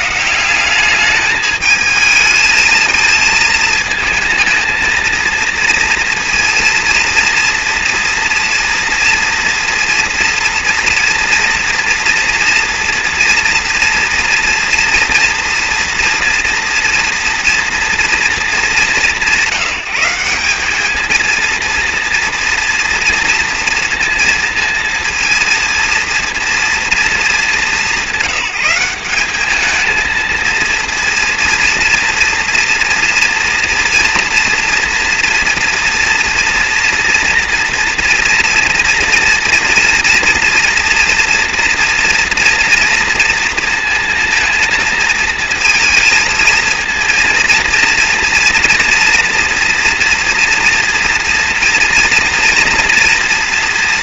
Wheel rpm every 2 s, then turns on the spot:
170, 220, 220, 230, 230, 230, 230, 230, 240, 200, 190, 230, 230, 230, 190, 230, 230, 230, 230, 230, 230, 230, 230, 230, 230, 230, 230.
none